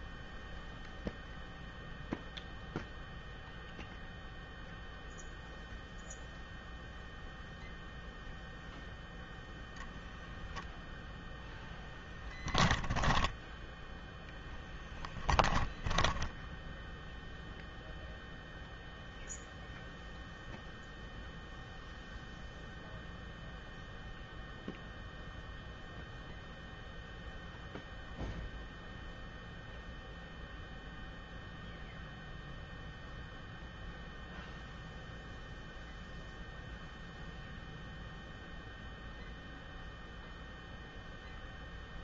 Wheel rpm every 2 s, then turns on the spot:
0, 0, 0, 0, 0, 0, 10, 10, 0, 0, 0, 0, 0, 0, 0, 0, 0, 0, 0, 0, 0.
12-14